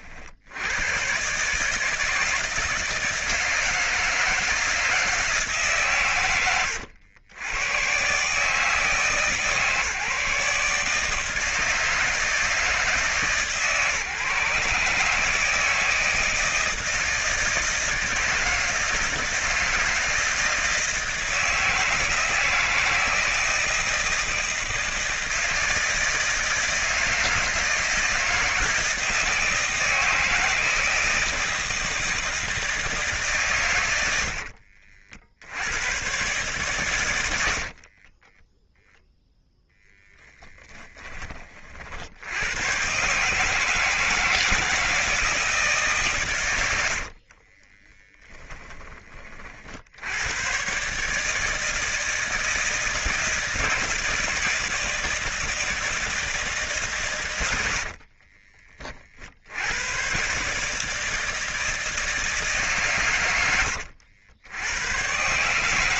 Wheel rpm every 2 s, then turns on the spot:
90, 160, 160, 110, 140, 140, 160, 150, 160, 160, 160, 170, 160, 160, 160, 160, 160, 60, 130, 0, 10, 110, 160, 100, 30, 120, 160, 160, 150, 30, 150, 150, 90.
34-36 40-42 46-50